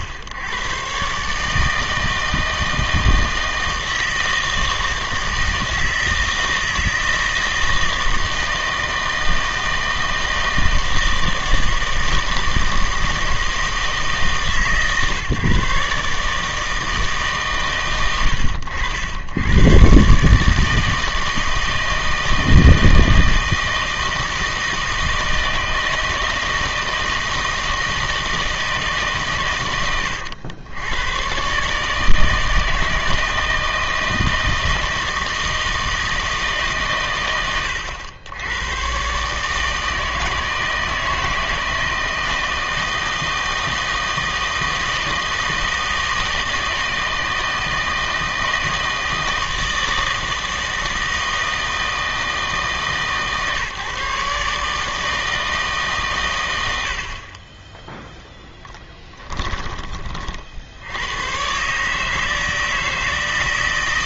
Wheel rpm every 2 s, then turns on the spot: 130, 160, 160, 160, 160, 160, 160, 140, 160, 80, 160, 160, 160, 160, 160, 90, 160, 160, 150, 110, 160, 160, 160, 160, 160, 160, 150, 150, 100, 10, 70, 160.
58-60